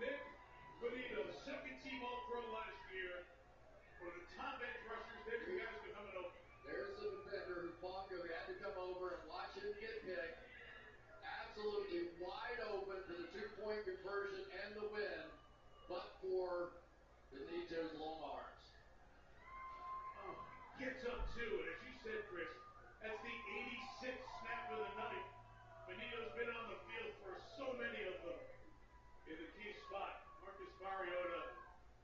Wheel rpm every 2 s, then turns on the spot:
0, 0, 0, 0, 0, 0, 0, 0, 0, 0, 0, 0, 0, 0, 0, 0.
none